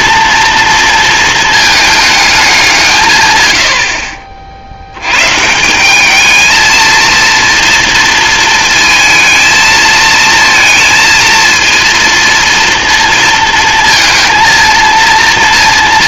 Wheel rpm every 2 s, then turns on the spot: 230, 170, 70, 230, 230, 230, 230, 230.
none